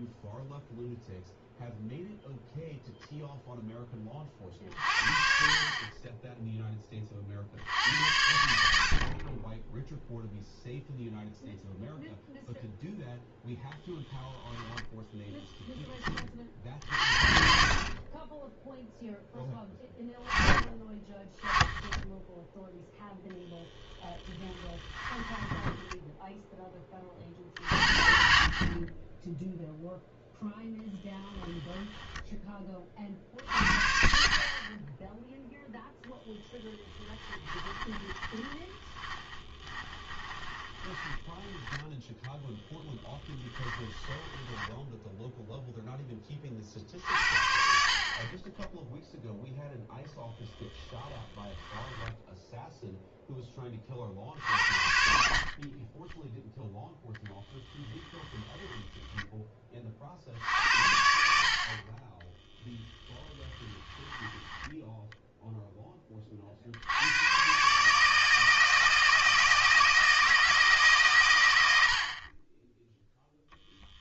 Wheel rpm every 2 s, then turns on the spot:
0, 0, 40, 20, 60, 0, 0, 10, 50, 0, 30, 0, 20, 20, 30, 10, 30, 20, 10, 20, 20, 10, 10, 50, 10, 10, 0, 50, 0, 10, 70, 10, 10, 70, 160, 140, 10.
24-26 36-42 44-46 50-52 58-60 62-66 72-74